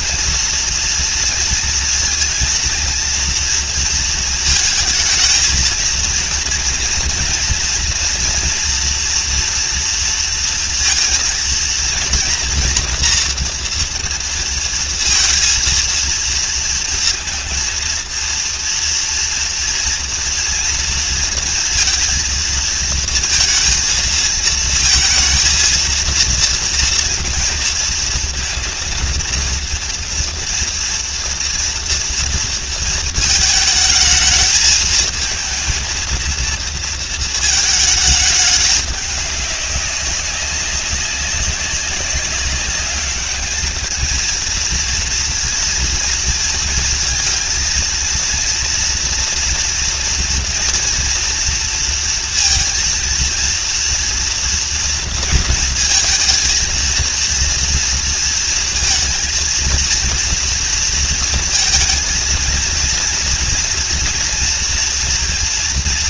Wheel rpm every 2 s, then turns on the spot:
230, 230, 220, 230, 240, 230, 230, 230, 230, 230, 230, 230, 230, 230, 230, 240, 230, 220, 230, 200, 190, 200, 230, 230, 230, 240, 230, 230, 230, 230, 230, 230, 230.
none